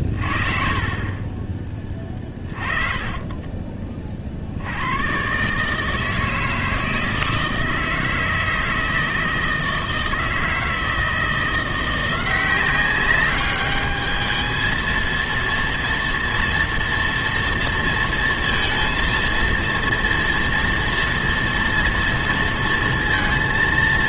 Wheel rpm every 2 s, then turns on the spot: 40, 30, 90, 160, 160, 160, 190, 220, 230, 230, 240, 230.
2-4